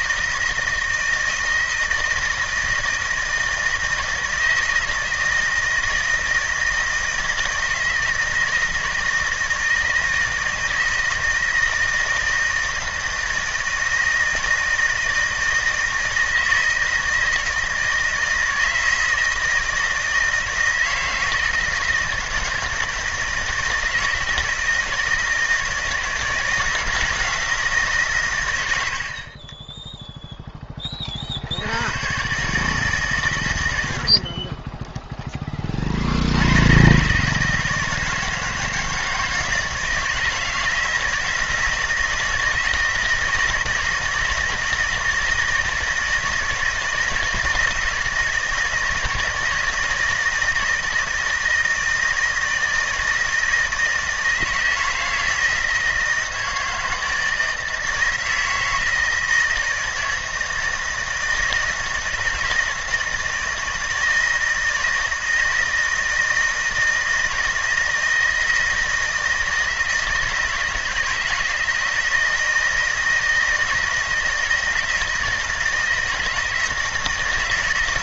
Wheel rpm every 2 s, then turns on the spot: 160, 160, 160, 160, 160, 160, 160, 160, 160, 160, 160, 160, 160, 170, 100, 10, 140, 20, 100, 160, 160, 170, 160, 160, 160, 160, 160, 160, 160, 160, 160, 160, 160, 160, 160, 160, 160, 160, 160.
34-36